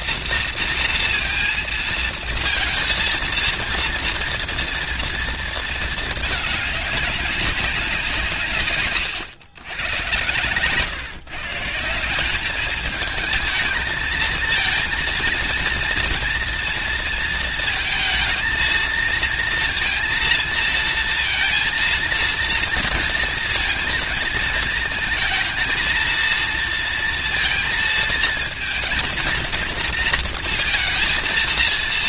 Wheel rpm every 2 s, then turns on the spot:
230, 230, 230, 210, 160, 120, 190, 220, 230, 220, 230, 230, 230, 230, 230, 230.
none